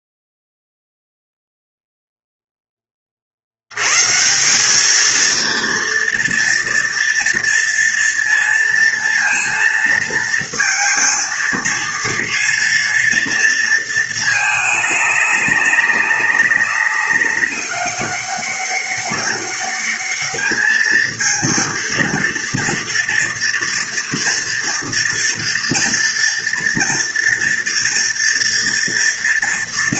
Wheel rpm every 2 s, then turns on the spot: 0, 10, 180, 230, 230, 230, 230, 220, 190, 200, 210, 230, 240, 240, 230.
none